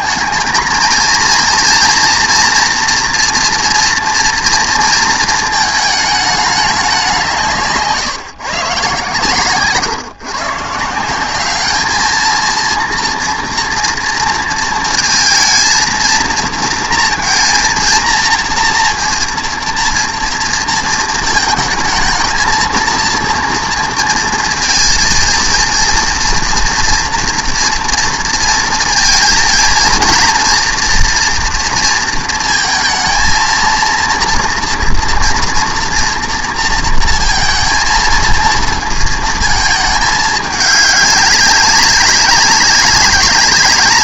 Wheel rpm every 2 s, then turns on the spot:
220, 240, 230, 200, 140, 150, 230, 230, 230, 230, 230, 230, 230, 230, 230, 240, 230, 230, 230, 230, 200, 200.
none